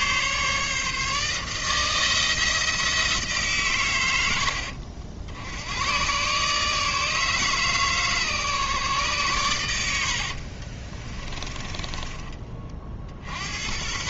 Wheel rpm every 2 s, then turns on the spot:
150, 160, 70, 150, 140, 30, 50.
10-12